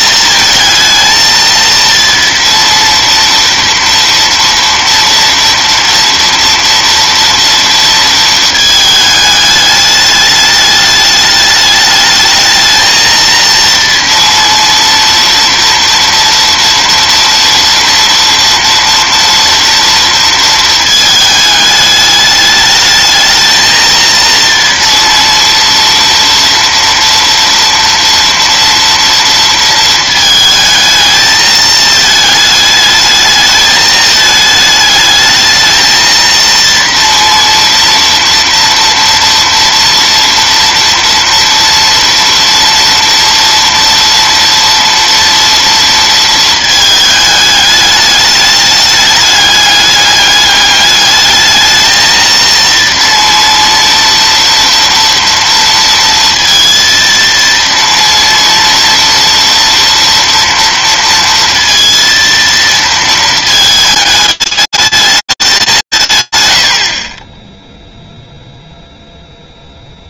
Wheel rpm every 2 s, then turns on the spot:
230, 230, 230, 230, 220, 210, 220, 230, 230, 230, 230, 210, 230, 230, 230, 220, 220, 220, 230, 230, 230, 230, 230, 230, 210, 200, 230, 240, 230, 230, 230, 230, 210, 160, 0.
none